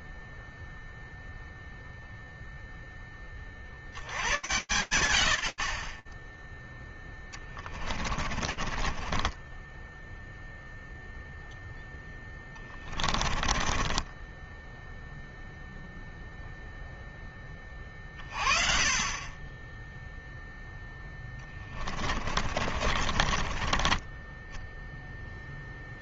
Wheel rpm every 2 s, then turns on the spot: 0, 0, 110, 10, 30, 0, 30, 0, 20, 20, 20, 40, 10.
8-10 12-14 20-24